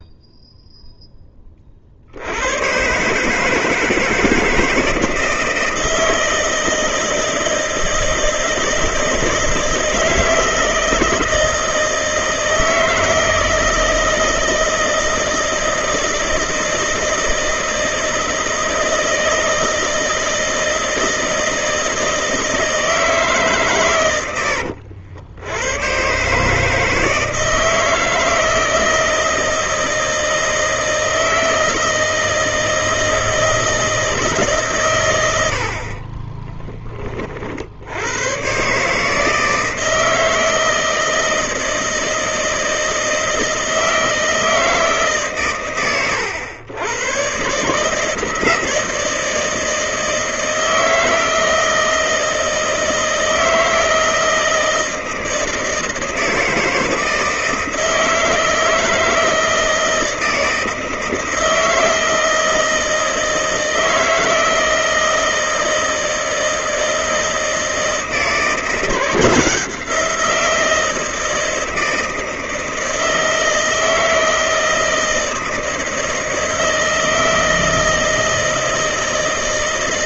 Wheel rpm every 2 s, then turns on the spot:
0, 100, 160, 160, 160, 160, 160, 160, 160, 160, 160, 160, 80, 150, 160, 160, 160, 140, 20, 130, 160, 160, 160, 100, 160, 160, 160, 160, 160, 160, 160, 160, 160, 160, 170, 170, 160, 160, 160, 160.
36-38